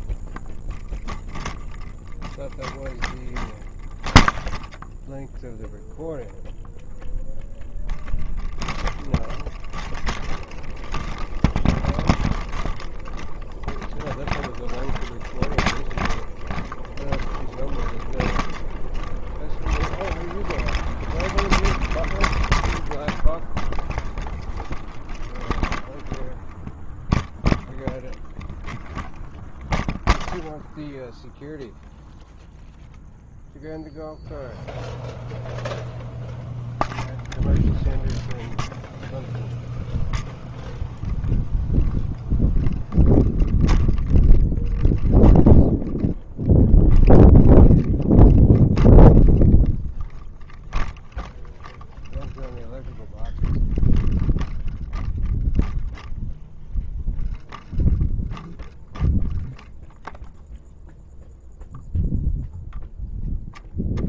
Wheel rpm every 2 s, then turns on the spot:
0, 0, 0, 0, 0, 0, 0, 0, 0, 0, 0, 0, 0, 0, 0, 0, 0, 0, 0, 0, 0, 0, 0, 0, 0, 0, 0, 0, 0, 0, 0, 0.
none